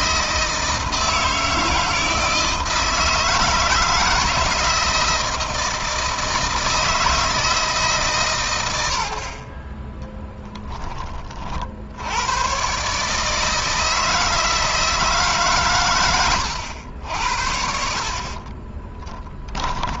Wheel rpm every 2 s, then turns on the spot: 160, 160, 170, 160, 100, 20, 130, 160, 80, 20.
18-20